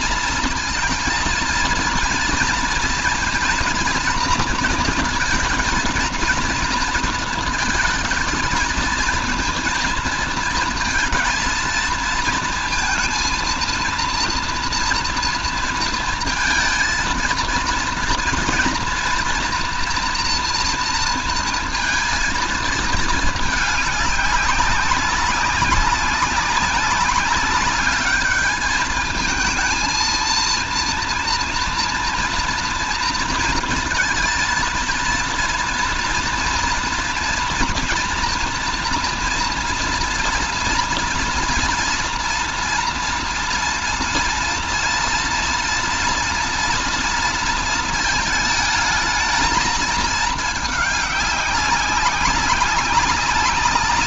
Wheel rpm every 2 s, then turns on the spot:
230, 230, 230, 230, 220, 230, 230, 230, 230, 230, 230, 230, 200, 200, 220, 230, 240, 230, 240, 230, 230, 230, 230, 230, 220, 210, 190.
none